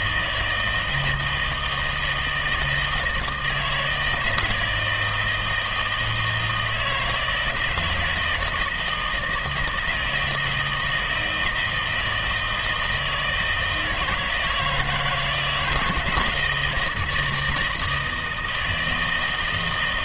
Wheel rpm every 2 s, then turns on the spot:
160, 160, 160, 160, 160, 160, 160, 160, 170, 160.
none